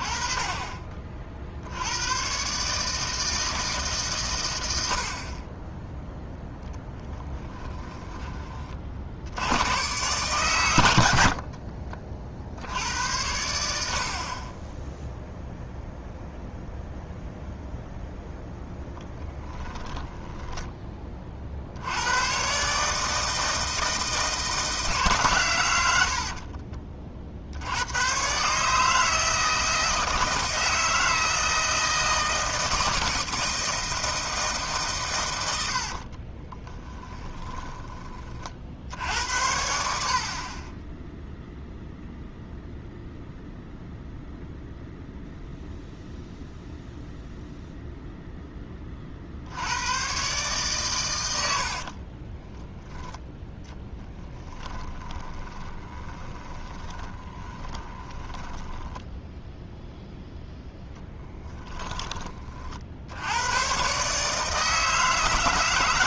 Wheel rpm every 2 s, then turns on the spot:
30, 140, 70, 10, 40, 100, 80, 10, 0, 0, 20, 140, 160, 30, 150, 160, 160, 130, 10, 60, 0, 0, 0, 0, 20, 130, 20, 20, 30, 10, 10, 50, 150.
6-8 36-38 54-62